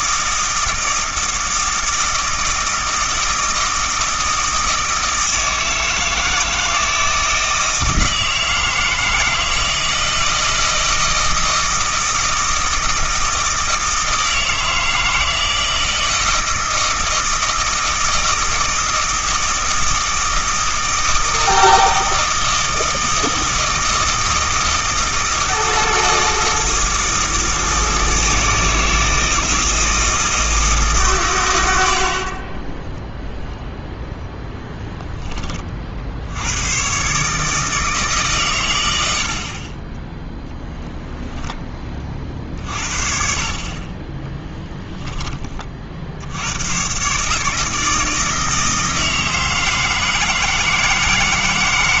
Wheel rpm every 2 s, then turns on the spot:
160, 160, 160, 160, 160, 160, 160, 160, 160, 160, 160, 160, 160, 160, 160, 160, 20, 0, 110, 110, 0, 50, 10, 110, 160, 160.
32-34